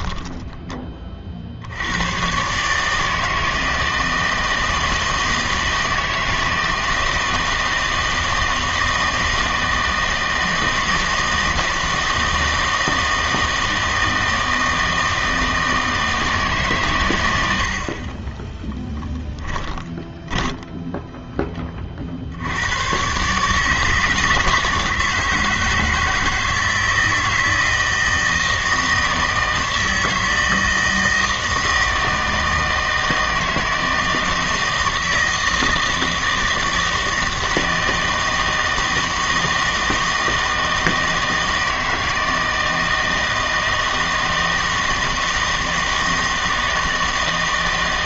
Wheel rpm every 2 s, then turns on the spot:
20, 140, 160, 160, 160, 160, 160, 160, 140, 10, 10, 100, 160, 160, 160, 160, 160, 160, 160, 160, 160, 160, 160, 160.
18-22